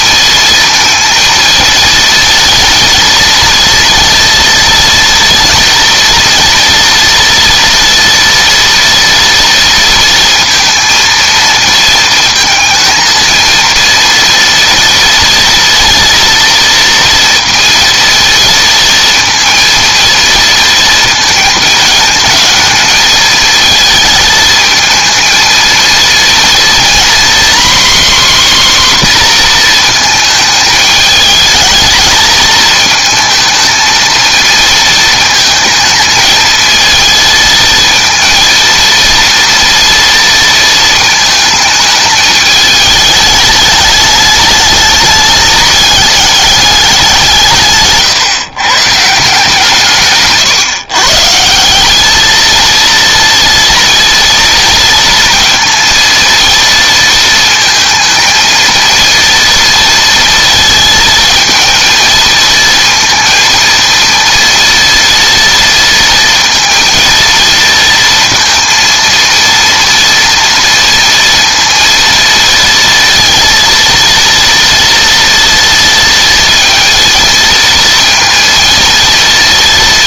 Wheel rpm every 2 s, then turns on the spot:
230, 230, 230, 230, 230, 230, 220, 230, 230, 230, 230, 220, 220, 240, 270, 220, 220, 220, 220, 230, 220, 210, 210, 200, 140, 130, 230, 230, 230, 230, 230, 230, 230, 230, 230, 230, 230, 230, 230, 230.
none